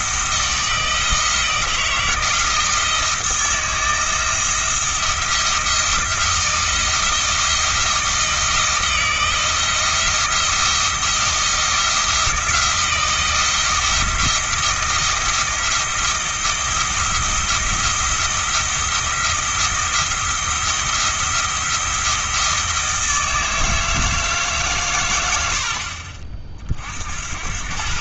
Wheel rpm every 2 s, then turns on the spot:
170, 160, 170, 170, 160, 170, 170, 170, 170, 170, 170, 160, 130, 50.
none